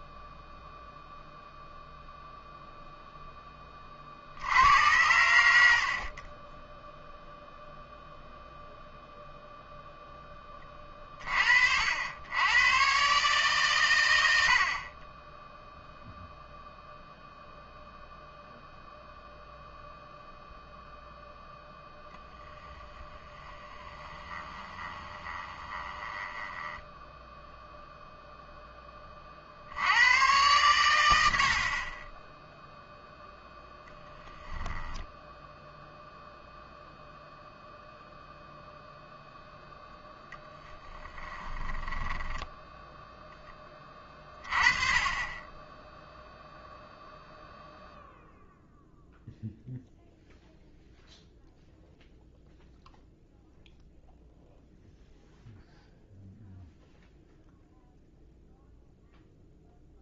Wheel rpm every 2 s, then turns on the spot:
0, 0, 90, 10, 0, 20, 120, 60, 0, 0, 0, 10, 20, 10, 10, 100, 0, 10, 0, 0, 10, 10, 20, 0, 0, 0, 0, 0, 0, 0.
24-28 40-42